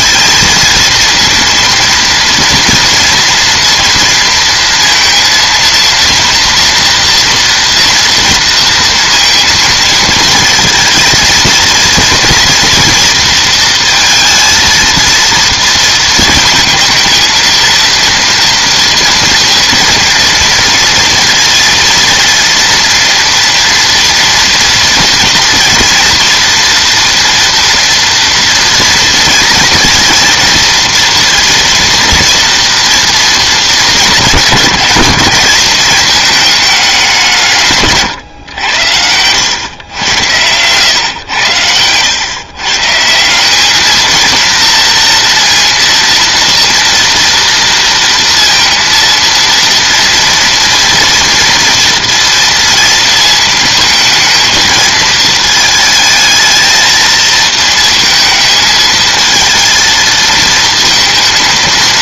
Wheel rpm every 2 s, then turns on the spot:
230, 230, 230, 240, 230, 230, 230, 230, 230, 230, 230, 230, 230, 230, 230, 230, 230, 190, 210, 100, 110, 130, 230, 230, 230, 230, 230, 220, 220, 220, 220.
none